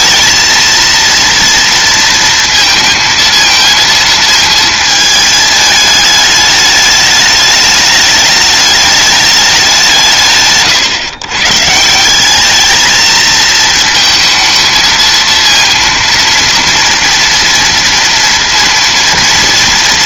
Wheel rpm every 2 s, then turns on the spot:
230, 230, 220, 210, 210, 130, 220, 220, 230, 230.
none